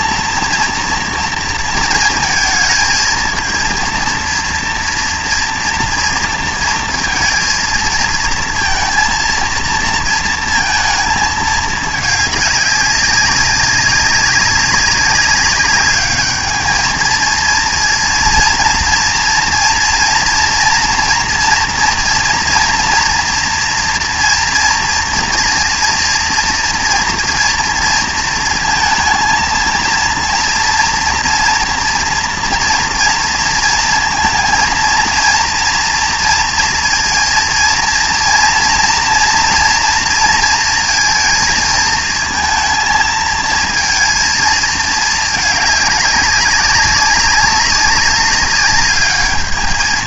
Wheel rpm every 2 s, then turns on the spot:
230, 220, 230, 230, 230, 220, 200, 200, 220, 230, 230, 240, 240, 240, 230, 230, 230, 230, 230, 230, 230, 220, 220, 200, 200.
none